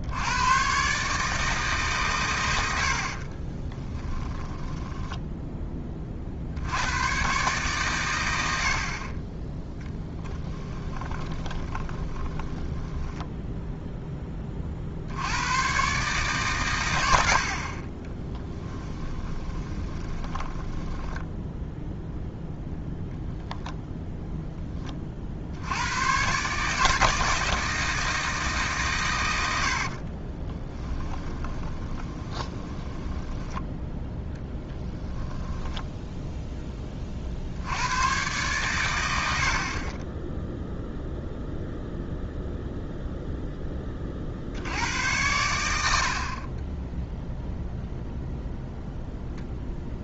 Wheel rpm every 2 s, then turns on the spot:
130, 90, 10, 80, 60, 20, 20, 50, 110, 10, 10, 0, 10, 150, 140, 20, 10, 10, 20, 110, 0, 0, 80, 20, 0.
4-6 10-14 18-22 30-36